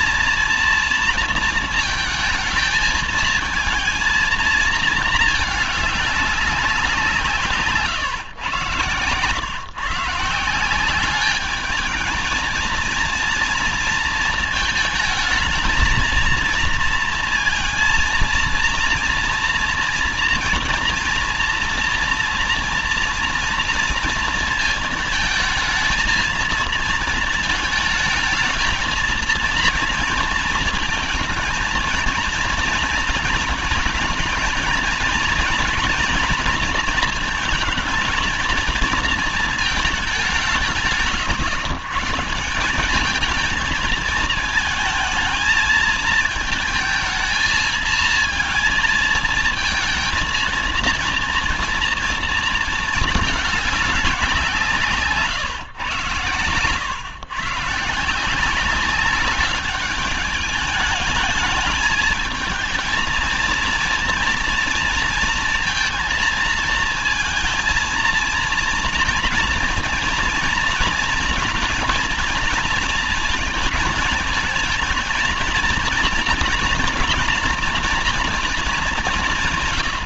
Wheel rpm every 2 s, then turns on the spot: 230, 220, 220, 190, 120, 180, 230, 220, 230, 230, 230, 230, 230, 230, 230, 220, 230, 230, 230, 230, 160, 190, 220, 220, 220, 230, 220, 160, 120, 190, 210, 220, 230, 230, 230, 230, 230, 220, 240, 220.
none